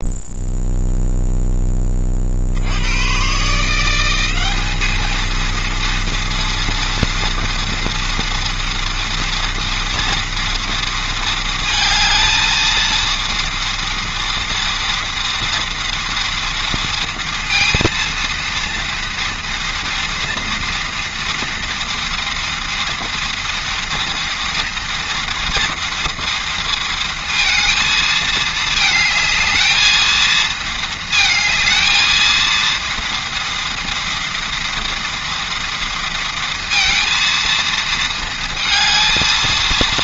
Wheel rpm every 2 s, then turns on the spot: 0, 90, 210, 230, 230, 230, 230, 230, 230, 230, 230, 230, 230, 230, 220, 220, 230, 230, 230, 230.
none